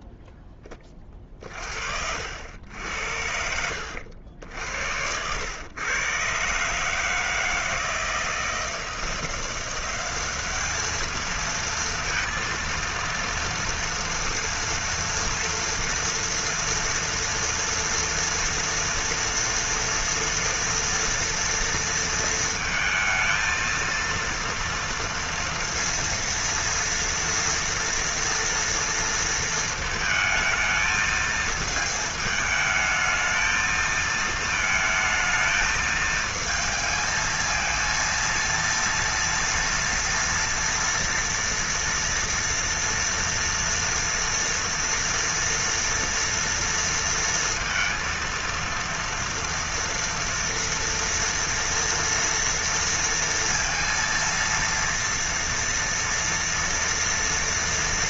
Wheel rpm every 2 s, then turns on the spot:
20, 80, 70, 140, 160, 210, 230, 230, 230, 230, 240, 220, 230, 230, 230, 220, 220, 220, 220, 230, 230, 240, 230, 230, 230, 230, 230, 230, 240.
none